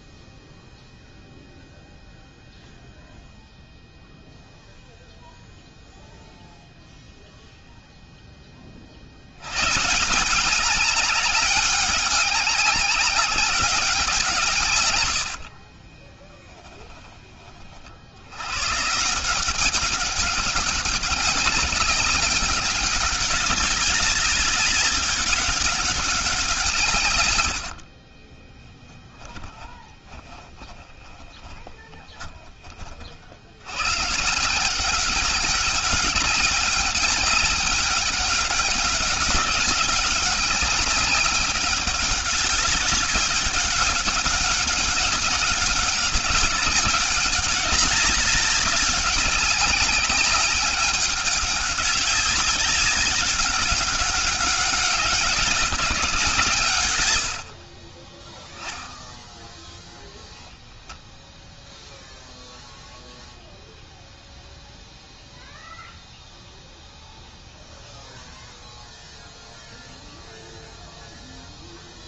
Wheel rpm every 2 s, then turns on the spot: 0, 0, 0, 0, 70, 210, 190, 100, 20, 160, 200, 200, 200, 140, 10, 20, 60, 190, 200, 200, 200, 200, 200, 200, 200, 200, 190, 180, 100, 10, 10, 0, 0, 0, 0, 0.
14-16 28-32